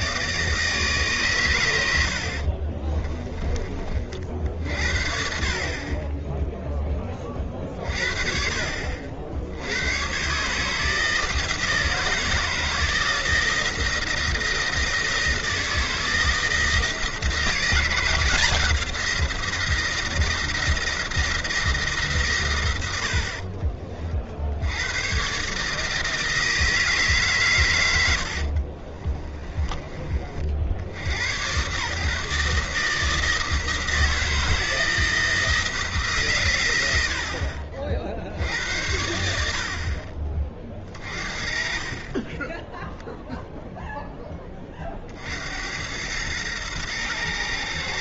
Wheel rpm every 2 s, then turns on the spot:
160, 40, 60, 0, 50, 150, 170, 170, 160, 170, 170, 120, 80, 160, 50, 80, 160, 160, 110, 80, 30, 10, 20, 110.
2-4 28-30